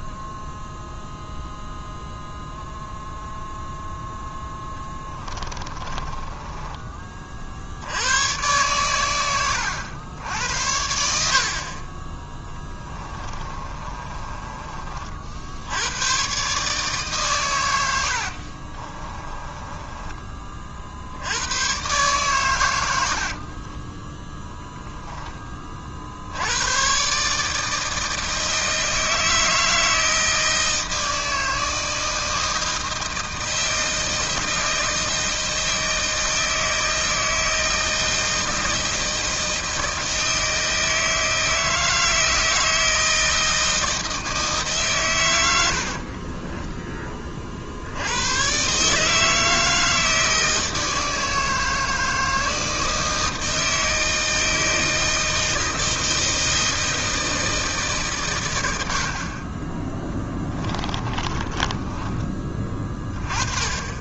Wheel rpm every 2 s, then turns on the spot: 0, 0, 10, 20, 110, 60, 20, 40, 140, 40, 60, 90, 10, 120, 160, 160, 160, 160, 160, 160, 160, 160, 140, 20, 140, 160, 160, 160, 160, 70, 20, 30.
4-6 12-14 18-20 60-62